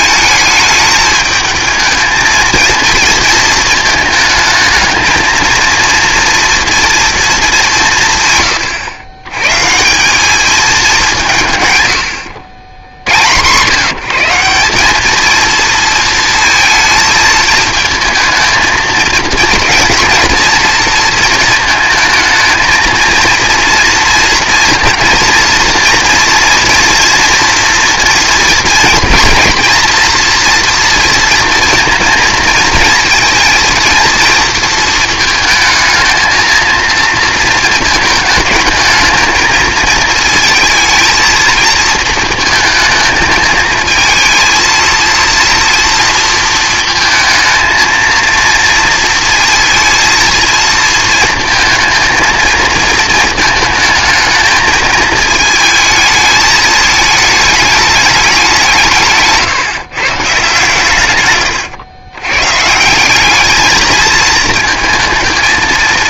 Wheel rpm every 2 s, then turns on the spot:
220, 230, 220, 230, 120, 210, 90, 190, 230, 220, 230, 220, 230, 240, 240, 240, 230, 220, 220, 220, 220, 220, 230, 230, 230, 220, 230, 220, 220, 180, 140, 140, 220.
none